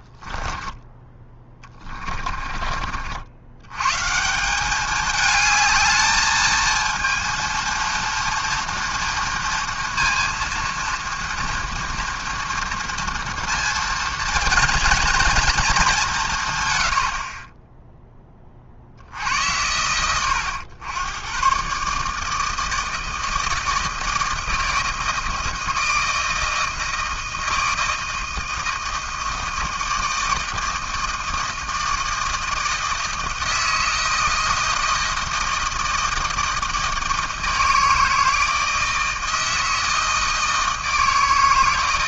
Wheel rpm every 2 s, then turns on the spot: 10, 30, 180, 220, 230, 230, 230, 230, 140, 40, 100, 160, 160, 160, 160, 160, 160, 160, 160, 160, 160.
0-4